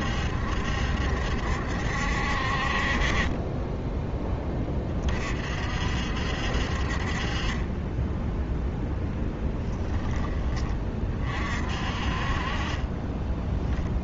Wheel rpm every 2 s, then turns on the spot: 70, 40, 30, 50, 0, 30, 20.
12-14